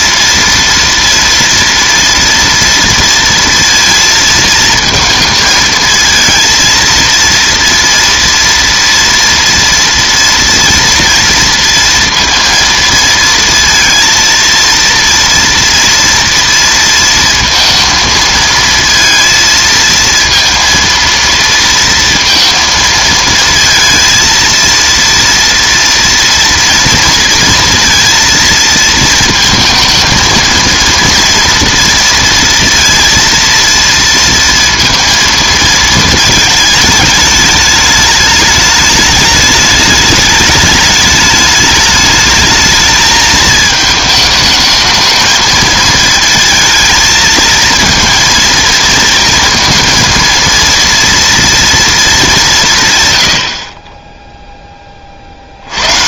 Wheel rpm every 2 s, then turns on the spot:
230, 230, 230, 230, 230, 230, 230, 230, 230, 220, 230, 230, 230, 230, 230, 230, 230, 230, 220, 210, 210, 220, 220, 220, 230, 230, 180, 10.
none